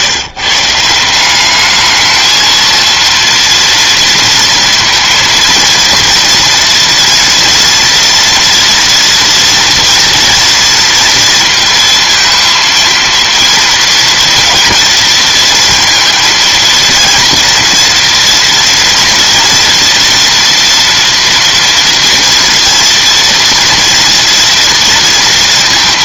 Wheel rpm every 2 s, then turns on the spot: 170, 230, 230, 230, 230, 230, 230, 230, 230, 230, 230, 230, 230.
none